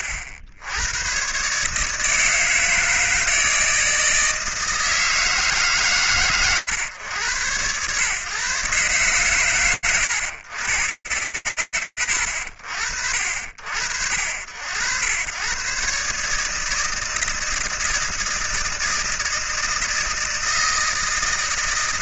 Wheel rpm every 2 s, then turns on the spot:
90, 160, 160, 120, 130, 80, 80, 120, 160, 160, 160.
none